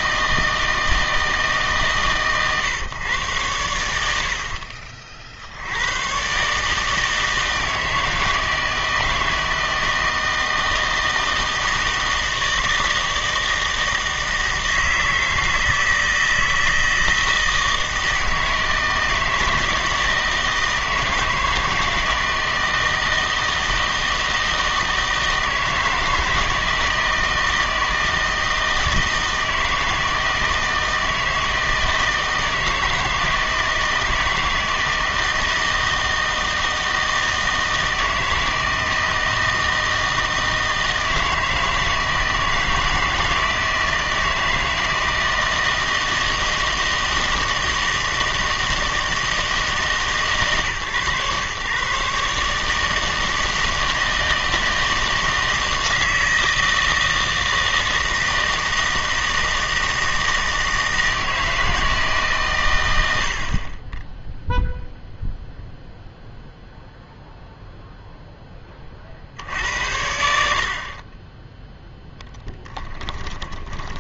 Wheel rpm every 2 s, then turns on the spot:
160, 130, 50, 150, 160, 160, 160, 160, 160, 160, 160, 160, 160, 160, 160, 160, 160, 160, 160, 160, 160, 160, 160, 160, 160, 140, 150, 160, 160, 160, 160, 110, 0, 0, 20, 60, 10.
4-6 72-74